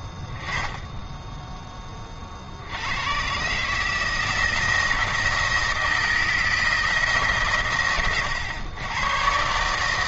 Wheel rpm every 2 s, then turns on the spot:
10, 90, 160, 160, 110.
none